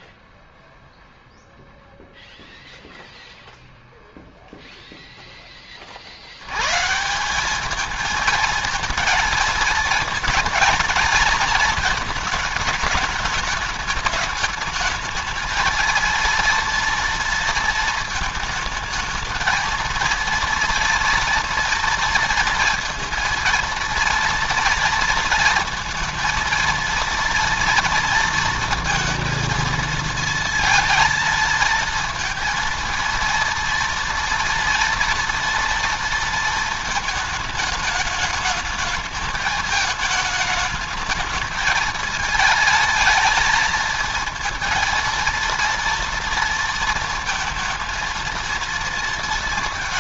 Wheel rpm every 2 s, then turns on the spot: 0, 0, 0, 140, 220, 230, 210, 220, 230, 220, 230, 230, 230, 230, 230, 220, 230, 230, 220, 210, 220, 220, 230, 230, 230.
none